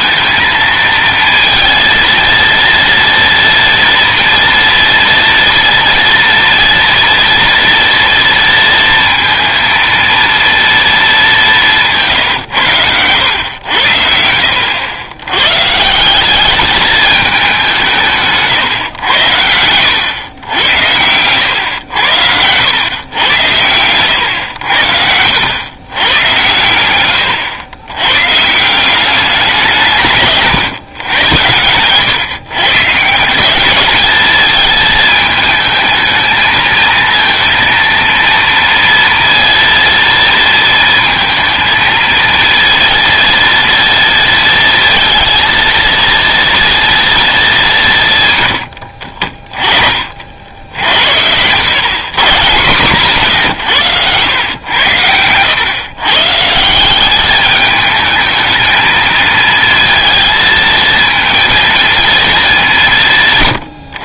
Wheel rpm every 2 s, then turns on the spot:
230, 230, 230, 240, 230, 220, 100, 90, 210, 120, 100, 100, 90, 110, 170, 130, 150, 220, 220, 230, 230, 230, 230, 230, 80, 80, 140, 100, 170, 220, 230, 190.
12-14